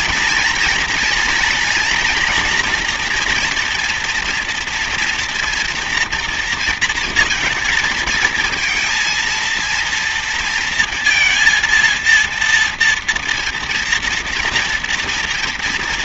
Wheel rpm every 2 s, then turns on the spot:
240, 240, 230, 230, 230, 230, 230, 230.
none